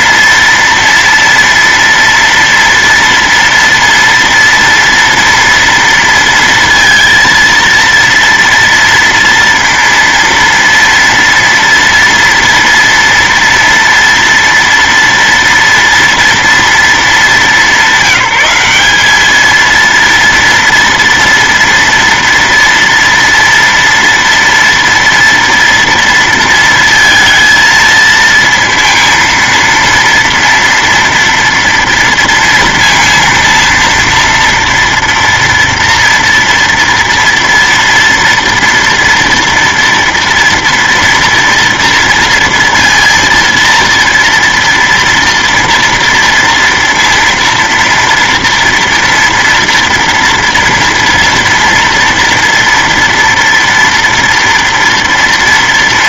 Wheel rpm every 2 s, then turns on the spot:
230, 230, 230, 230, 230, 230, 230, 230, 230, 200, 230, 230, 230, 230, 230, 230, 230, 230, 230, 230, 230, 230, 230, 230, 230, 230, 230, 230.
none